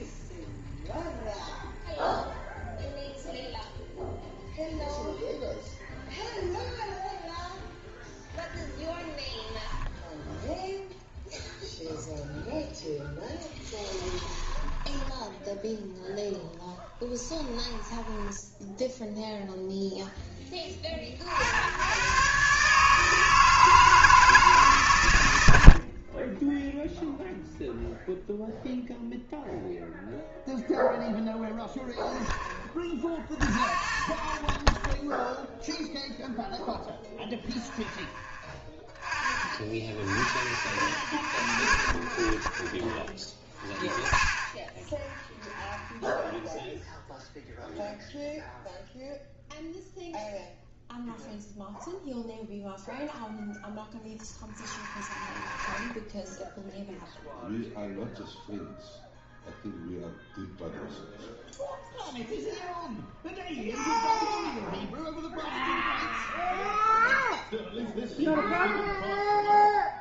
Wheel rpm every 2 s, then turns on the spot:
0, 0, 0, 0, 0, 0, 0, 10, 10, 0, 20, 150, 140, 10, 0, 0, 0, 0, 0, 0, 0, 0, 0, 0, 0, 0, 0, 0, 0, 0, 0, 0, 0, 0, 0.
14-18 26-28